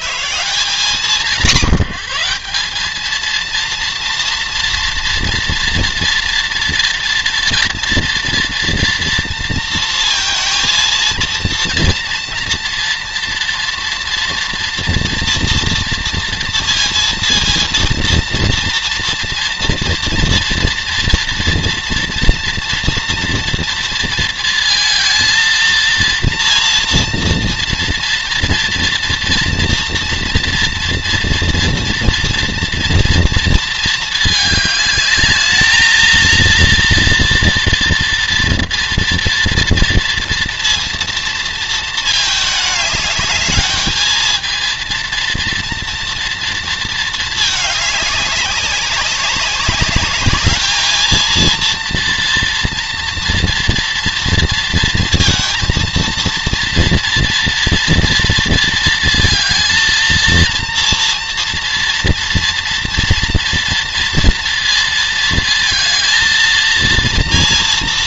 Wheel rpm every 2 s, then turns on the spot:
150, 200, 230, 230, 230, 230, 230, 230, 230, 230, 230, 230, 230, 230, 230, 230, 230, 210, 230, 230, 230, 220, 230, 230, 190, 210, 240, 230, 230, 230, 230, 230, 230, 230.
none